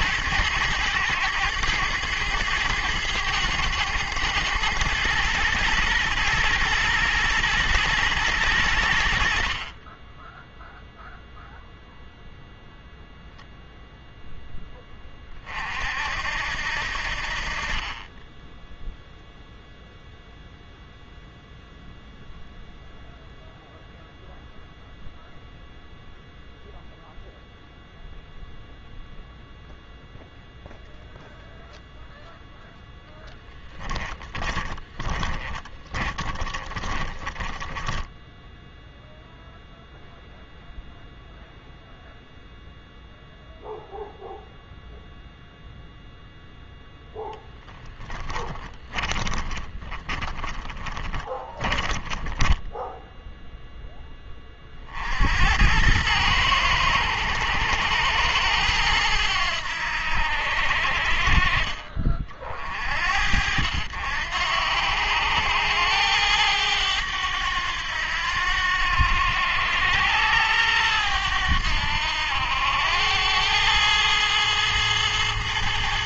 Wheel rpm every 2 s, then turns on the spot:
100, 100, 110, 120, 90, 0, 0, 10, 70, 0, 0, 0, 0, 0, 0, 0, 0, 20, 20, 0, 0, 0, 0, 0, 20, 20, 10, 40, 100, 100, 70, 50, 90, 100, 90, 100, 90, 110.
34-38 48-54